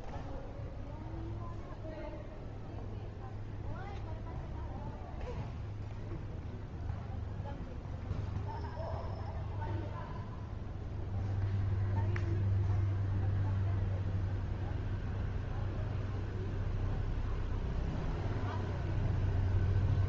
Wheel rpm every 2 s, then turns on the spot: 0, 0, 0, 0, 0, 0, 0, 0, 0, 0.
none